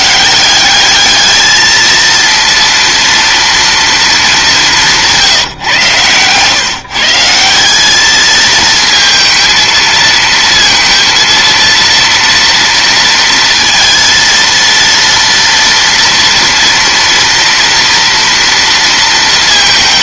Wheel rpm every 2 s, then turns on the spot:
190, 230, 200, 140, 220, 230, 230, 230, 230, 230.
none